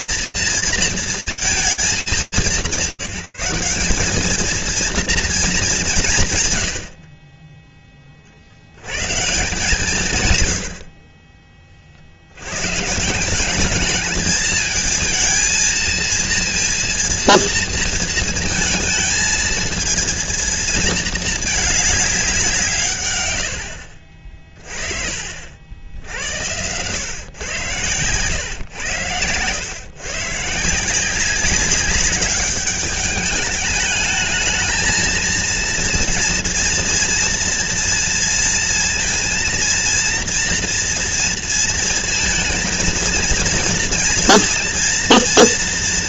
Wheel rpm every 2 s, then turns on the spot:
230, 180, 230, 50, 160, 40, 170, 220, 230, 230, 220, 100, 50, 120, 100, 170, 200, 230, 230, 230, 230, 230, 230.
none